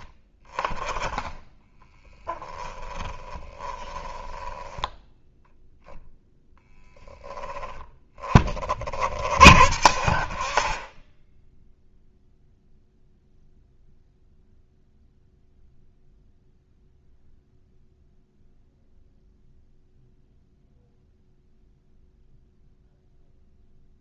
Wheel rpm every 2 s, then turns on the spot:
20, 10, 10, 0, 40, 30, 0, 0, 0, 0, 0, 0.
2-4